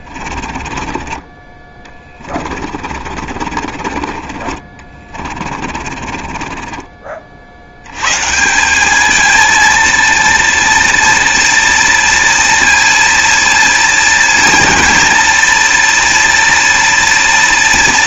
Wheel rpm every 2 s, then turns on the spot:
30, 30, 30, 30, 190, 230, 240, 230, 230.
0-8